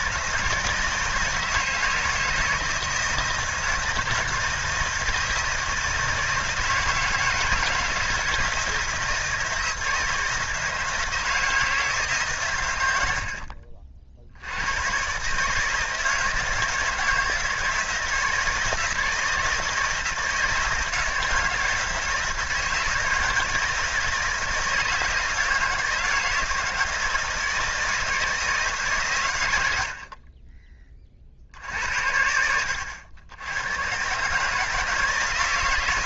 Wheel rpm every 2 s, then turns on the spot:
160, 160, 160, 160, 160, 160, 120, 90, 160, 160, 160, 160, 160, 160, 150, 30, 80, 150.
32-34